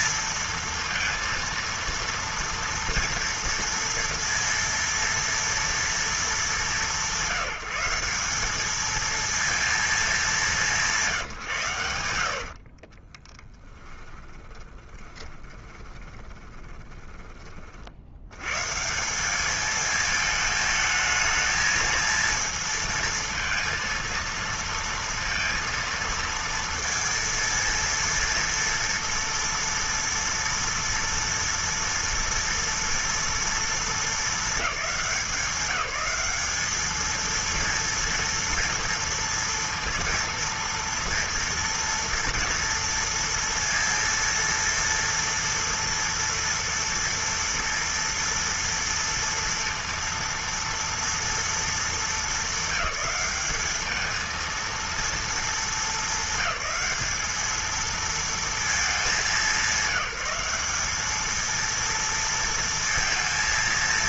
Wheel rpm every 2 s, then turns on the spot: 230, 230, 230, 220, 190, 210, 80, 10, 20, 90, 220, 220, 230, 230, 230, 230, 230, 220, 190, 230, 230, 230, 230, 230, 230, 230, 220, 220, 210, 230, 190, 230.
12-18